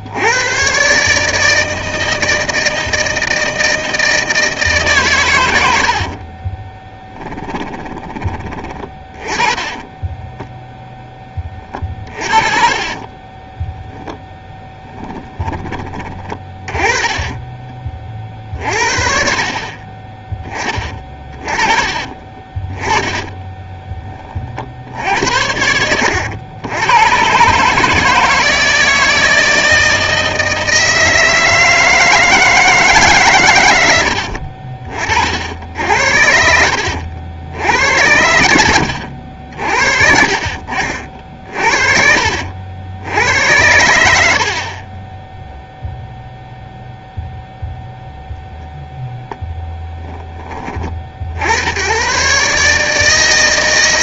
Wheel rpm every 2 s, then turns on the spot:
90, 160, 150, 20, 20, 0, 30, 10, 20, 40, 30, 20, 70, 100, 160, 160, 150, 50, 80, 80, 50, 80, 40, 0, 0, 30, 150.
6-10 12-18 20-24 40-42